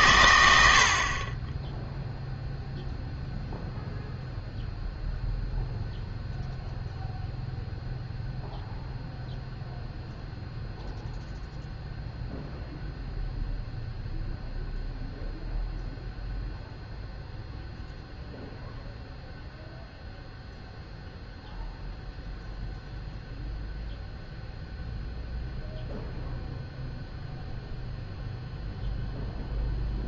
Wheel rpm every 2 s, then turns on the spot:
60, 0, 0, 0, 0, 0, 0, 0, 0, 0, 0, 0, 0, 0, 0.
none